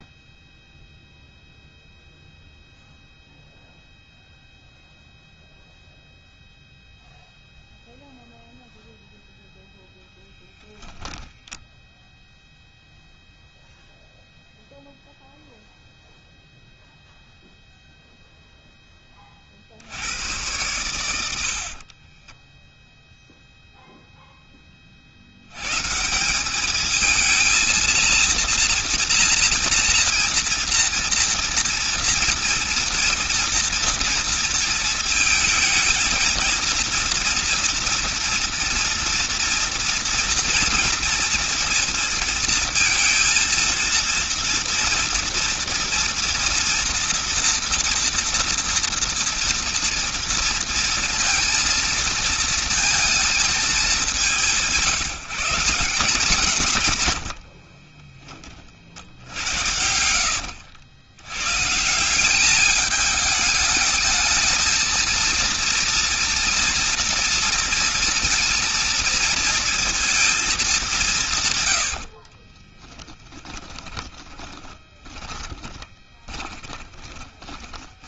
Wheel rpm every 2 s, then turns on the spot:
0, 0, 0, 0, 0, 0, 0, 0, 0, 0, 90, 20, 0, 170, 230, 230, 230, 230, 230, 230, 230, 230, 230, 230, 230, 230, 230, 180, 180, 30, 70, 190, 220, 230, 230, 220, 50, 10, 20.
22-24 58-60 72-78